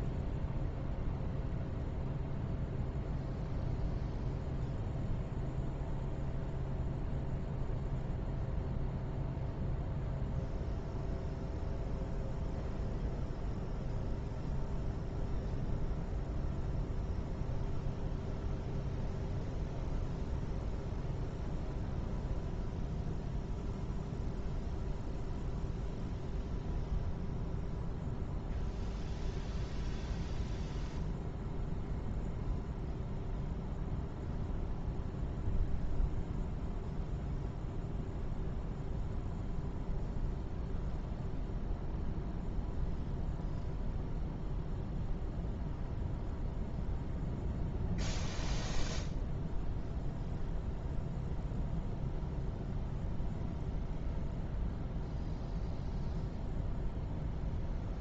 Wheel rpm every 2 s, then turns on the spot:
0, 0, 0, 0, 0, 0, 0, 0, 0, 0, 0, 0, 0, 0, 0, 0, 0, 0, 0, 0, 0, 0, 0, 0, 0, 0, 0, 0, 0.
none